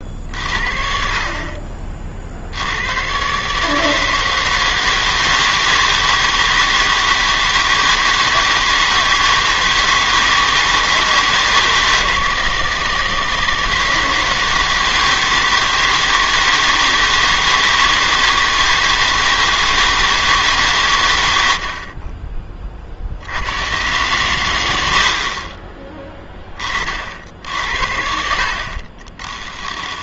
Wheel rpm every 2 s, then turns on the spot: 50, 70, 160, 160, 160, 160, 160, 160, 160, 160, 150, 30, 100, 30, 50.
none